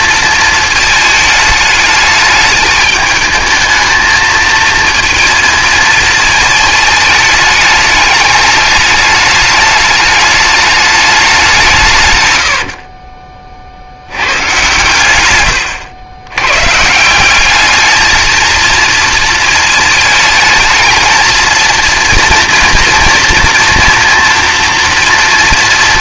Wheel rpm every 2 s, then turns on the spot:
220, 210, 220, 210, 210, 210, 60, 110, 150, 230, 220, 230, 230.
12-14